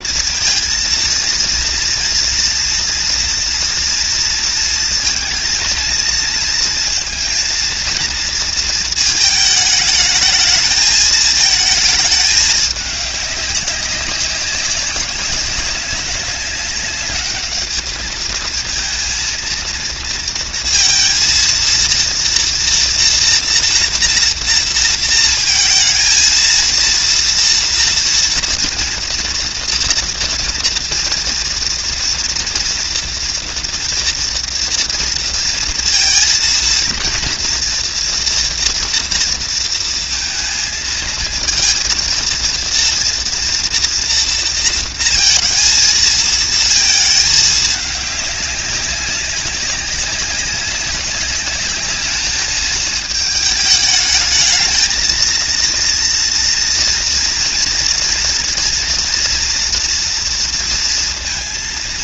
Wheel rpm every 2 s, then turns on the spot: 230, 240, 230, 230, 230, 210, 220, 190, 200, 220, 230, 230, 230, 220, 230, 230, 240, 230, 230, 240, 230, 230, 230, 230, 200, 200, 210, 210, 230, 230, 230.
none